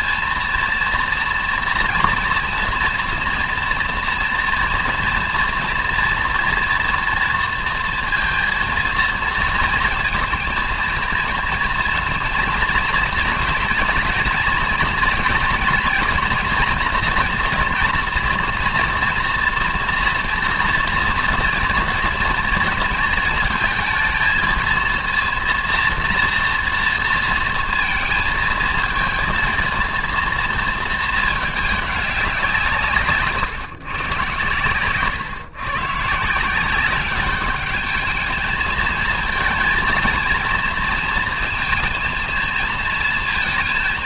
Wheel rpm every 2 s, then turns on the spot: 230, 240, 230, 230, 230, 230, 240, 230, 230, 230, 230, 230, 230, 230, 220, 230, 160, 130, 190, 220, 230, 230.
none